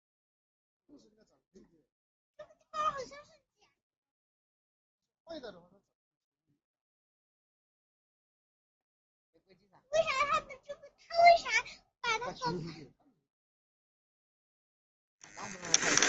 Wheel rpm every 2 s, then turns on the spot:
0, 0, 0, 0, 0, 0, 0, 0.
none